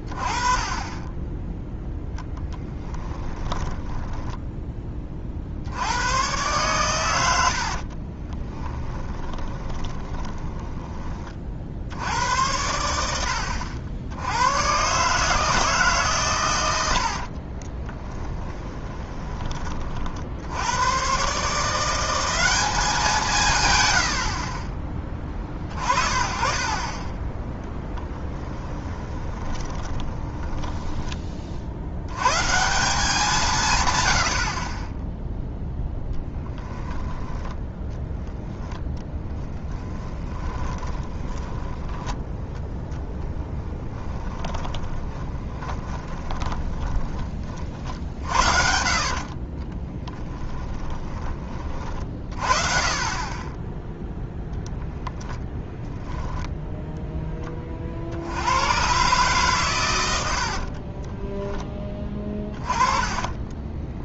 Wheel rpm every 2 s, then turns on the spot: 20, 10, 20, 110, 20, 20, 90, 130, 90, 20, 110, 190, 30, 30, 20, 10, 170, 20, 10, 10, 20, 10, 10, 20, 70, 20, 40, 0, 0, 120, 40, 30.
2-4 8-12 18-20 28-30 40-42 44-48 50-52 60-64